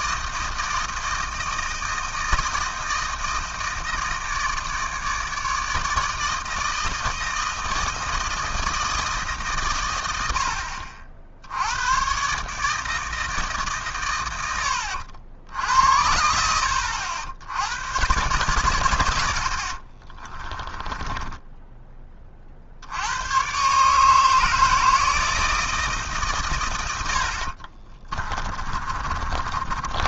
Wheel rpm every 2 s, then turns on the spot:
160, 160, 160, 160, 160, 60, 150, 90, 80, 120, 20, 60, 160, 110, 30.
20-22 28-30